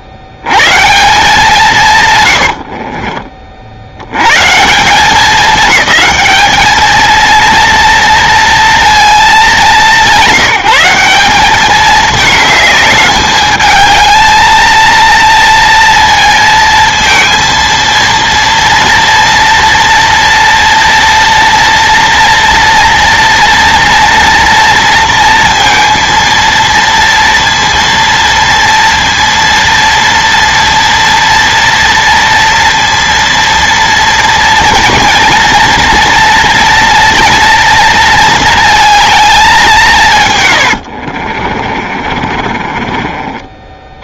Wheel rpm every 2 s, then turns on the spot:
110, 80, 160, 220, 230, 170, 210, 230, 230, 230, 230, 230, 240, 230, 230, 230, 230, 230, 230, 220, 100, 40.
2-4 40-44